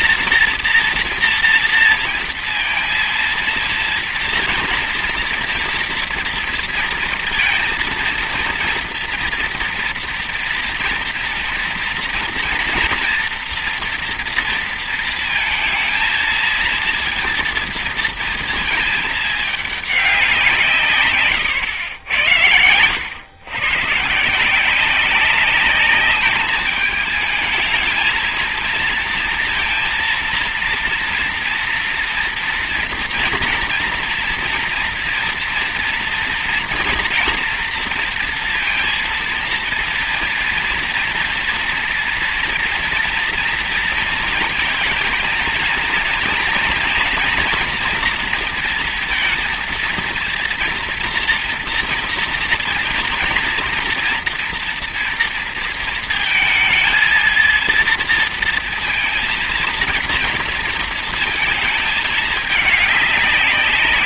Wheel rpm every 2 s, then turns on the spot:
230, 230, 230, 230, 230, 230, 240, 230, 230, 220, 140, 100, 180, 220, 230, 230, 240, 230, 230, 230, 230, 230, 230, 230, 230, 230, 230, 230, 230, 230, 230, 200.
none